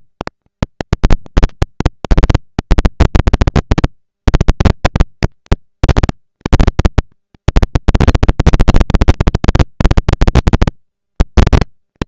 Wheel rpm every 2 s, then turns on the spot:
190, 210, 230, 230, 230, 230.
none